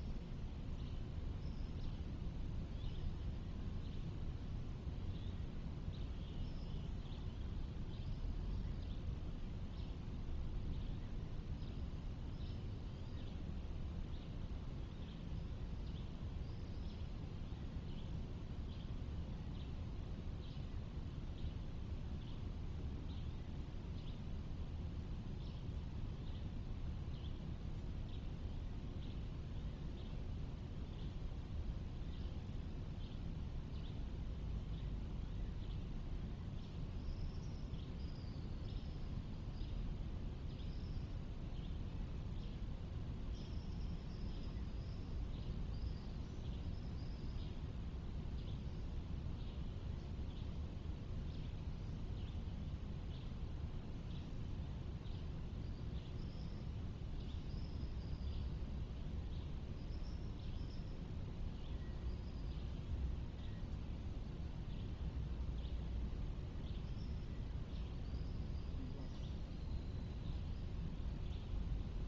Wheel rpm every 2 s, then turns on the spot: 0, 0, 0, 0, 0, 0, 0, 0, 0, 0, 0, 0, 0, 0, 0, 0, 0, 0, 0, 0, 0, 0, 0, 0, 0, 0, 0, 0, 0, 0, 0, 0, 0, 0, 0, 0.
none